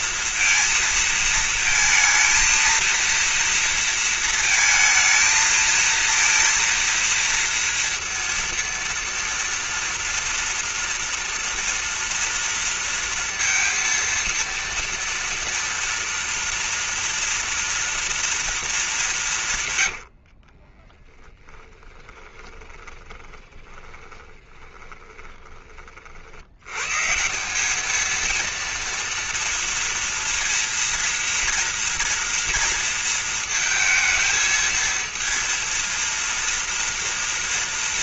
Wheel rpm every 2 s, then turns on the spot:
230, 230, 230, 230, 230, 230, 230, 230, 230, 230, 50, 20, 20, 90, 230, 230, 230, 220, 230.
20-26